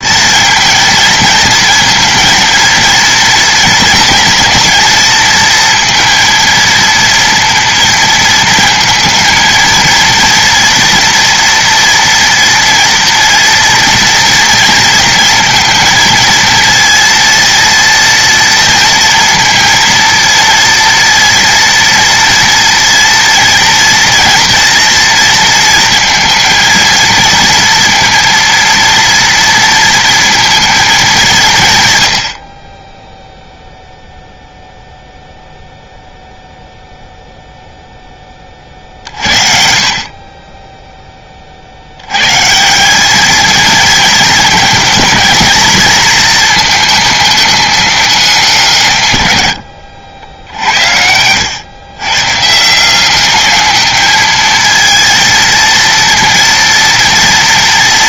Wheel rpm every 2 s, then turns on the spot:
230, 230, 230, 230, 230, 230, 230, 230, 230, 230, 230, 230, 230, 230, 230, 220, 20, 0, 0, 40, 10, 180, 220, 220, 160, 80, 160, 220, 230.
none